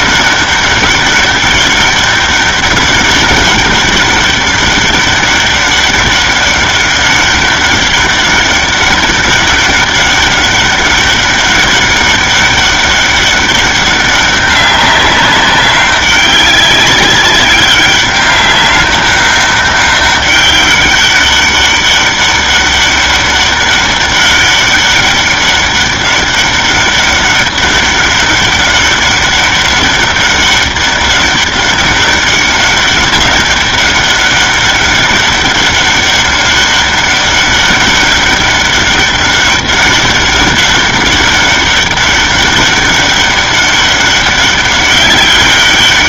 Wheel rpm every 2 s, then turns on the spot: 200, 200, 200, 200, 200, 200, 200, 190, 190, 200, 200, 200, 190, 200, 200, 200, 200, 200, 200, 200, 200, 200, 200.
none